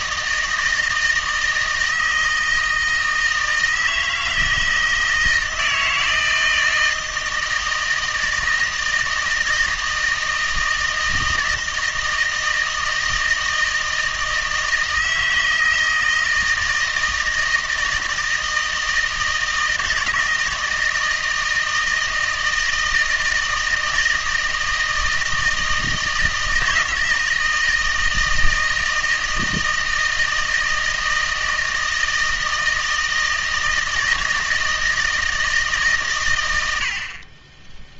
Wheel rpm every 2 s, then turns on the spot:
160, 160, 160, 160, 160, 160, 160, 160, 160, 160, 160, 160, 160, 160, 160, 160, 160, 160, 70.
none